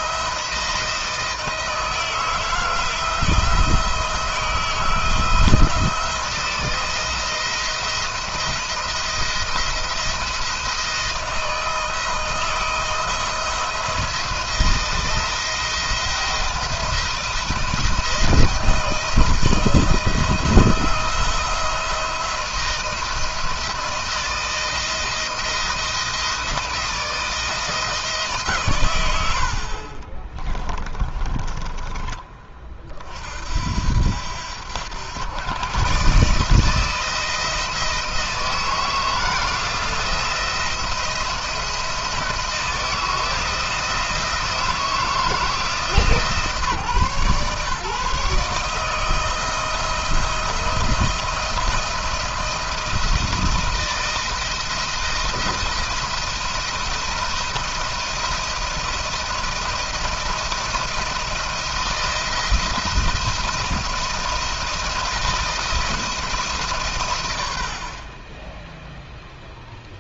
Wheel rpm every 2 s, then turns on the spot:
160, 170, 160, 160, 170, 160, 160, 170, 170, 170, 160, 170, 170, 160, 120, 20, 40, 90, 160, 160, 170, 160, 160, 140, 160, 170, 170, 170, 170, 170, 160, 170, 160, 140, 10.
30-32